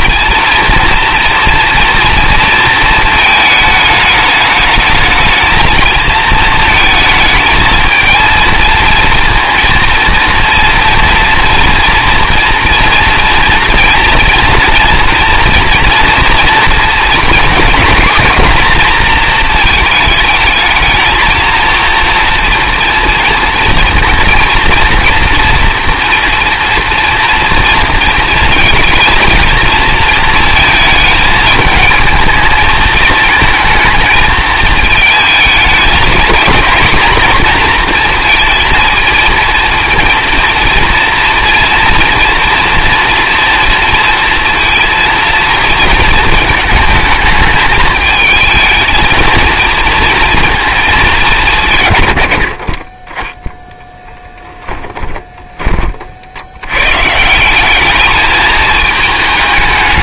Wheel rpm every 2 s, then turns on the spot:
240, 220, 220, 220, 230, 230, 230, 240, 240, 230, 220, 230, 230, 230, 220, 220, 220, 220, 230, 230, 230, 230, 230, 230, 220, 220, 50, 10, 110, 210.
54-56